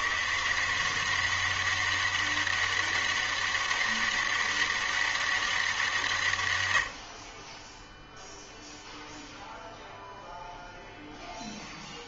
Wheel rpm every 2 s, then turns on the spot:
160, 200, 200, 110, 0, 0.
none